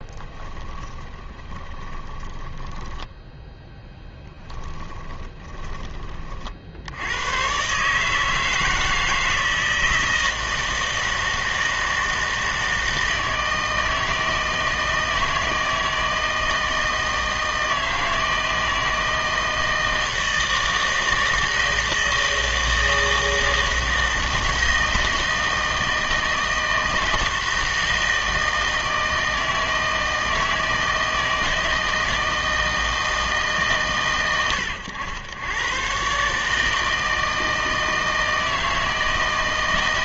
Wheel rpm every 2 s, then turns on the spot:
10, 10, 20, 50, 160, 160, 160, 160, 160, 160, 160, 160, 160, 160, 160, 160, 160, 100, 150, 160.
0-6